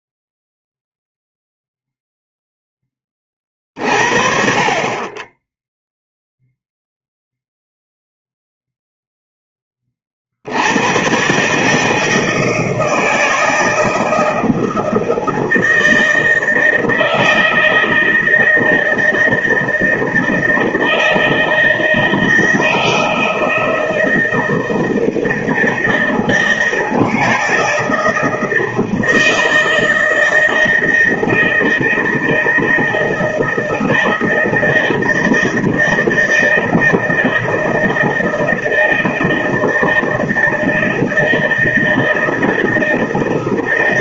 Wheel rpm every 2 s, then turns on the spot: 0, 10, 40, 0, 0, 80, 160, 160, 160, 160, 160, 160, 160, 160, 160, 160, 160, 160, 160, 160, 160, 160.
none